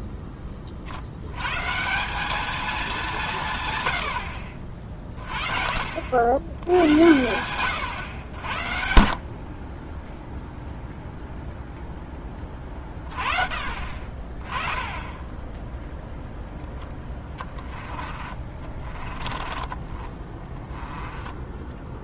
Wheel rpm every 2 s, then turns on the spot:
30, 220, 50, 100, 60, 0, 30, 20, 10, 30, 10.
16-22